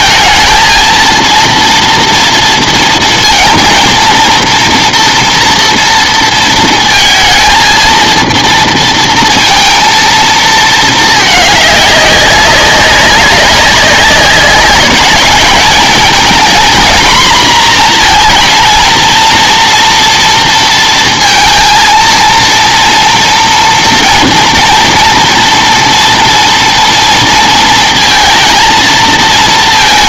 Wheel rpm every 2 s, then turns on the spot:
230, 230, 230, 230, 230, 230, 190, 200, 230, 220, 230, 230, 230, 230, 230.
none